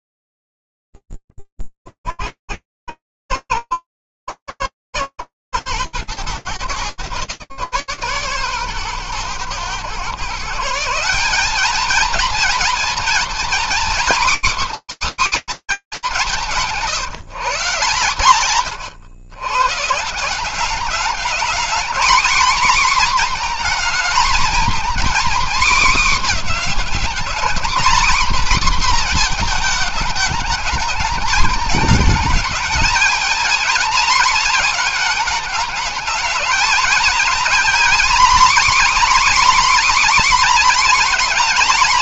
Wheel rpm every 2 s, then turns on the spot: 0, 70, 110, 130, 130, 140, 230, 270, 180, 130, 200, 240, 250, 230, 250, 220, 220, 220, 240, 260, 240.
none